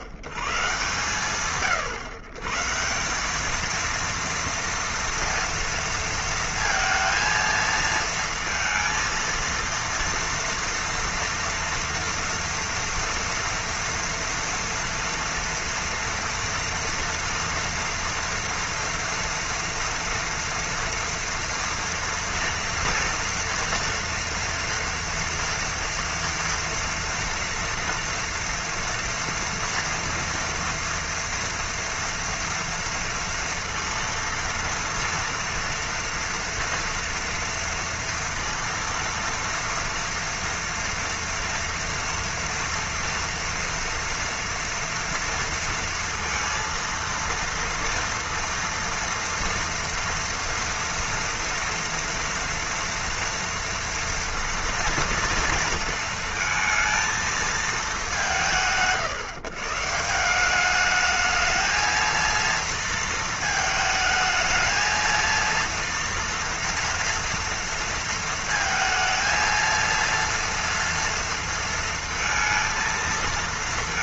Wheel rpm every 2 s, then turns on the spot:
120, 140, 230, 230, 230, 230, 230, 240, 230, 230, 240, 230, 230, 240, 230, 240, 230, 230, 230, 230, 230, 230, 230, 230, 230, 230, 230, 230, 230, 150, 170, 230, 220, 230, 230, 230, 230.
none